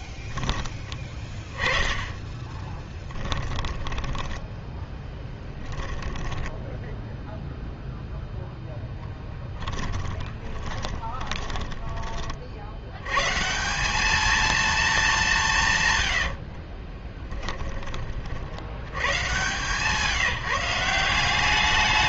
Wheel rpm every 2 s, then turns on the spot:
10, 20, 10, 10, 10, 20, 70, 220, 40, 100, 170.
2-12 16-18